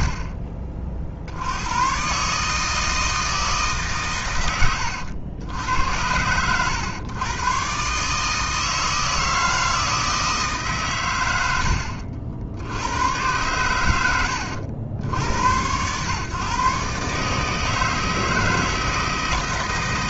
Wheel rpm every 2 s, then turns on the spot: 50, 160, 100, 110, 160, 130, 90, 80, 140, 160.
none